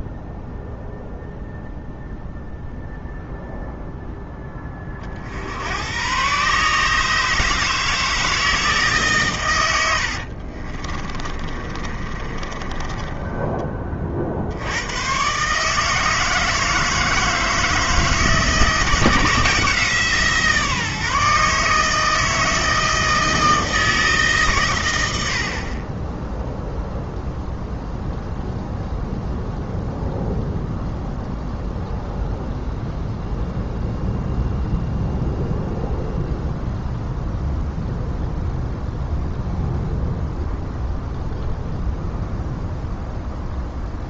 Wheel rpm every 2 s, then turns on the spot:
0, 0, 20, 150, 160, 40, 20, 90, 160, 160, 150, 160, 110, 0, 0, 0, 0, 0, 0, 0, 0, 0.
10-14